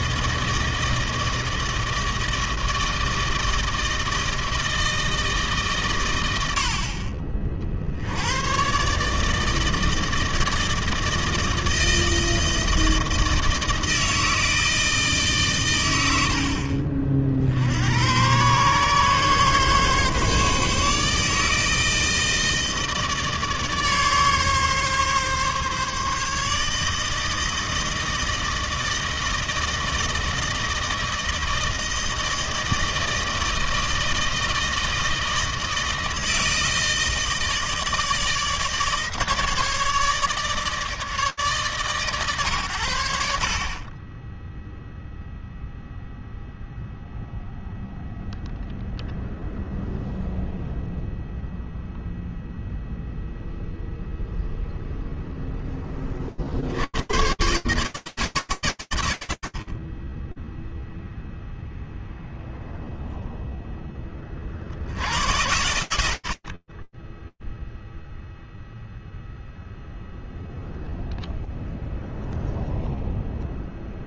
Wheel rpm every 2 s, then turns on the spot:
160, 160, 160, 140, 70, 160, 160, 160, 100, 90, 140, 160, 140, 150, 160, 160, 160, 160, 160, 160, 150, 90, 0, 0, 0, 0, 0, 0, 110, 120, 0, 0, 80, 20, 0, 0, 0.
none